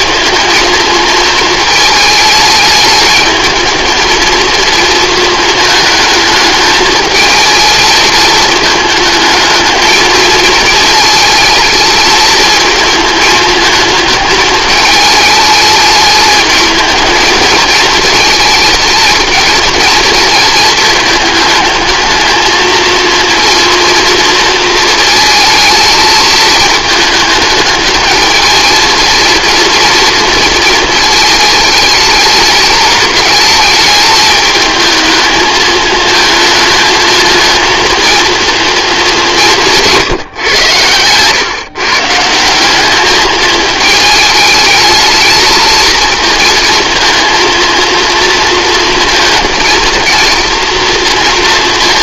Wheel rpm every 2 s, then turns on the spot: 220, 220, 220, 220, 220, 220, 220, 210, 220, 230, 220, 230, 220, 210, 230, 220, 210, 220, 230, 160, 150, 220, 220, 230, 230, 230.
none